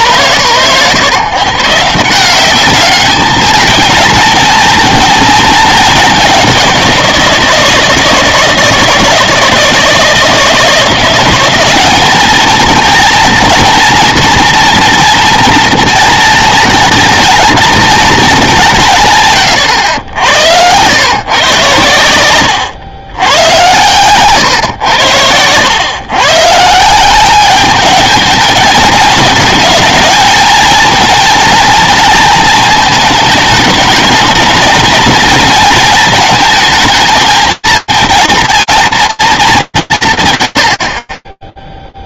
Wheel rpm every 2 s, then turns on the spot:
110, 200, 230, 190, 160, 170, 230, 230, 220, 200, 110, 100, 110, 150, 220, 230, 220, 220, 230, 230, 90.
none